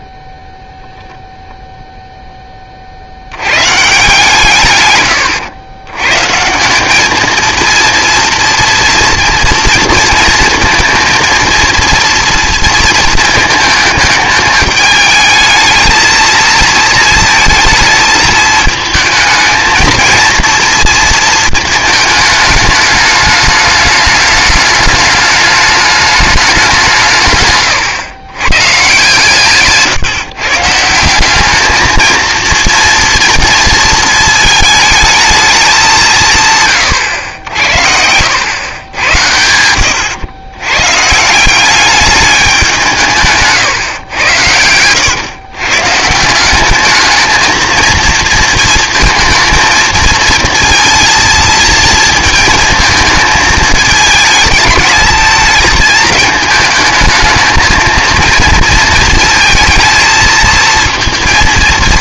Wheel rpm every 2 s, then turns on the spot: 0, 140, 120, 230, 230, 230, 210, 220, 220, 220, 220, 210, 210, 120, 150, 220, 230, 200, 70, 90, 200, 130, 140, 230, 230, 230, 220, 220, 220, 230, 230.
42-44